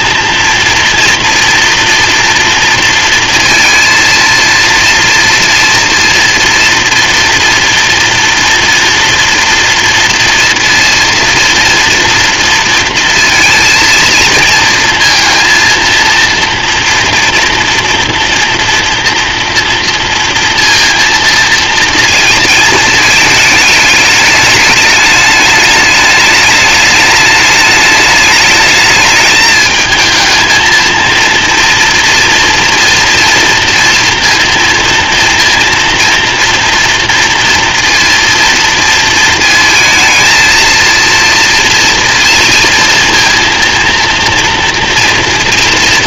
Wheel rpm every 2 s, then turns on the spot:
230, 230, 230, 230, 230, 230, 230, 230, 230, 230, 230, 220, 210, 210, 210, 230, 230, 230, 240, 230, 230, 230, 230.
none